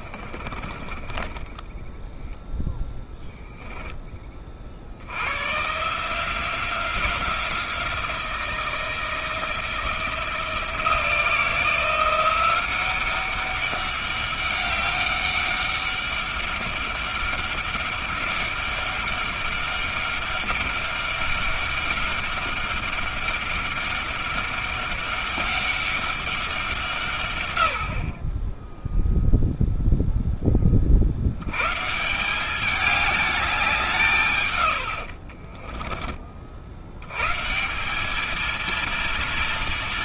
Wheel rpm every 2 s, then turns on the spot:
30, 0, 60, 180, 170, 170, 190, 200, 200, 200, 200, 200, 200, 160, 10, 30, 200, 110, 80, 230.
0-2 34-36